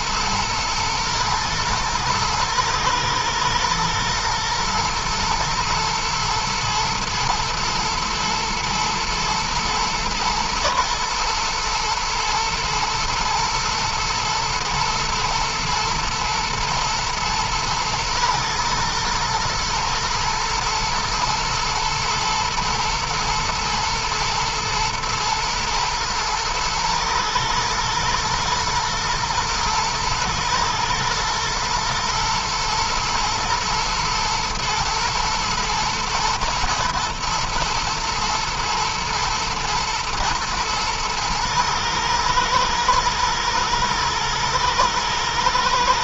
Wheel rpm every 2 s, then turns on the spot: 110, 120, 120, 120, 120, 120, 110, 110, 110, 110, 110, 110, 120, 110, 110, 110, 110, 120, 110, 120, 120, 120, 110.
none